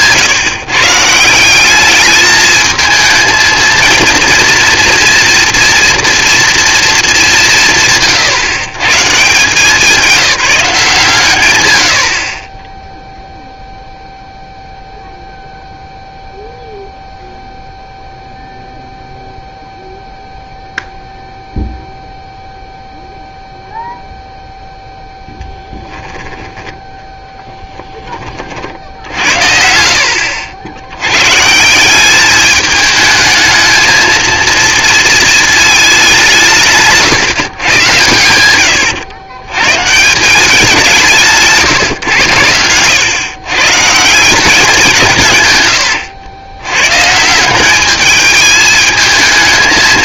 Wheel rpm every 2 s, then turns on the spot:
130, 220, 230, 230, 140, 180, 20, 0, 0, 0, 0, 0, 0, 10, 50, 80, 210, 230, 140, 100, 180, 100, 180, 110, 220.
38-40 42-44